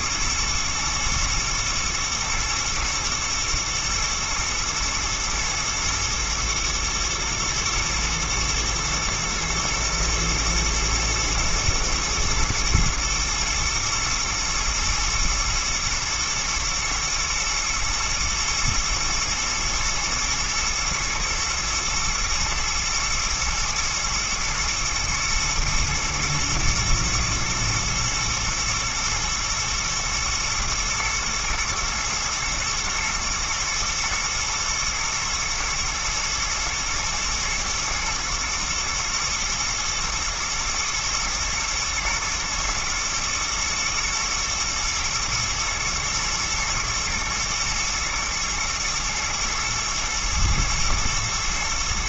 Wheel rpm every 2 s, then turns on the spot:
110, 120, 110, 110, 110, 120, 110, 110, 120, 120, 110, 120, 120, 120, 120, 120, 120, 120, 120, 110, 110, 110, 110, 110, 110, 120.
none